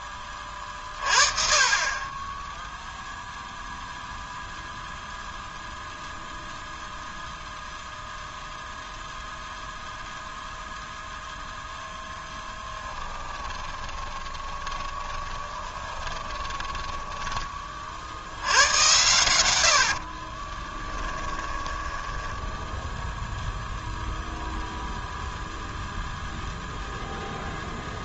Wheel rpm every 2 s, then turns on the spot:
40, 0, 0, 0, 0, 0, 10, 20, 20, 100, 30, 0, 0, 0.
12-18 20-22